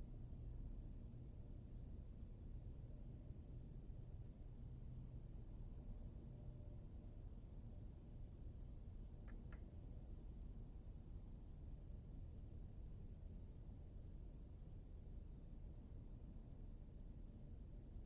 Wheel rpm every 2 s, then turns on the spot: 0, 0, 0, 0, 0, 0, 0, 0, 0.
none